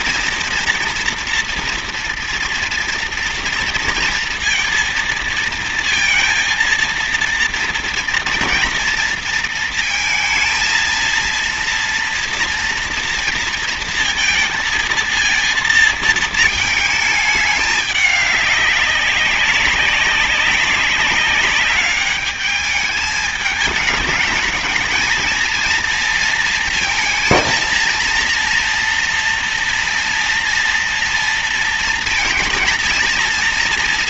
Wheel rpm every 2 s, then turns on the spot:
230, 230, 230, 230, 230, 230, 230, 230, 220, 200, 190, 210, 210, 230, 240, 240, 230.
none